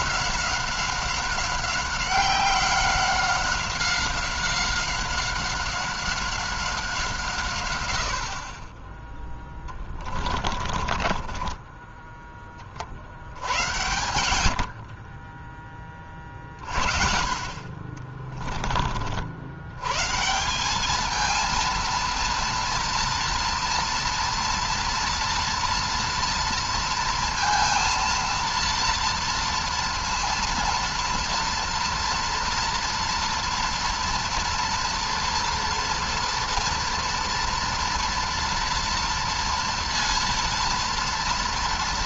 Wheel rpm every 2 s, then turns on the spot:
190, 190, 190, 180, 20, 30, 40, 50, 50, 40, 210, 230, 230, 230, 230, 230, 230, 230, 230, 230, 230.
10-12